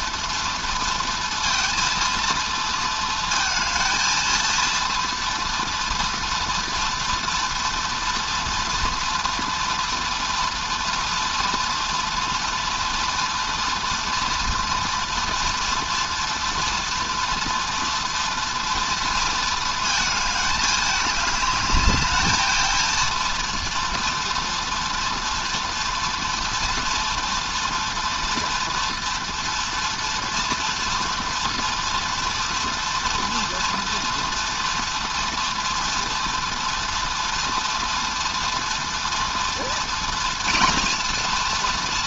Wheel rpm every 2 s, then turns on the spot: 230, 230, 230, 230, 230, 240, 230, 230, 230, 230, 210, 230, 230, 230, 230, 230, 240, 230, 230, 230, 240.
none